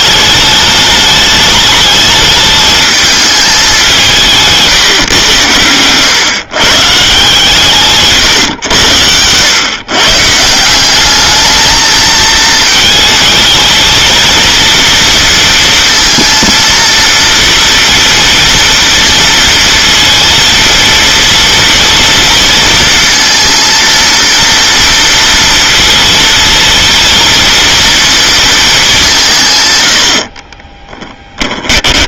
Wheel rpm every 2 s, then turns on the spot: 210, 220, 160, 140, 100, 170, 220, 230, 230, 230, 230, 230, 240, 230, 210, 20.
30-32